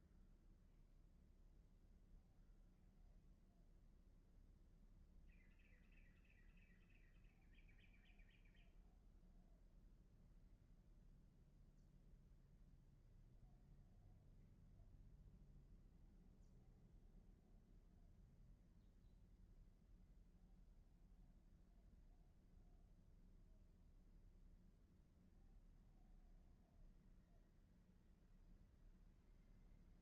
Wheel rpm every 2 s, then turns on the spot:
0, 0, 0, 0, 0, 0, 0, 0, 0, 0, 0, 0, 0, 0, 0.
none